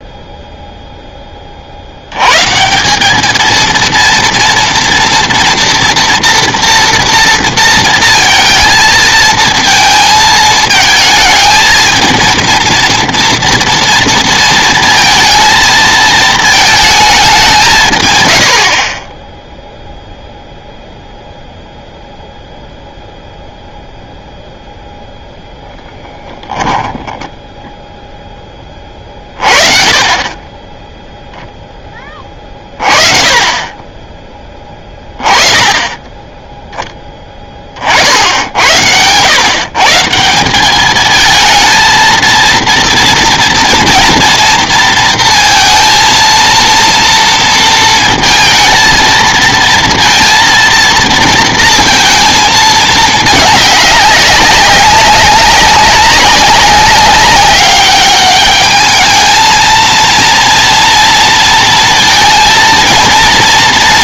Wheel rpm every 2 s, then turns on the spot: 0, 170, 230, 230, 230, 220, 230, 230, 230, 50, 0, 0, 0, 10, 30, 10, 30, 20, 10, 80, 200, 230, 230, 230, 220, 230, 220, 190, 190, 210, 230, 230.
26-28